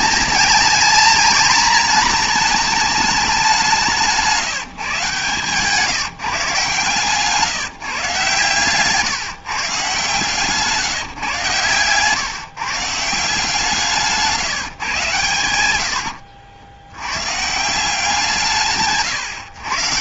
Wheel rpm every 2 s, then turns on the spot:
230, 220, 160, 150, 130, 150, 150, 140, 80, 150.
none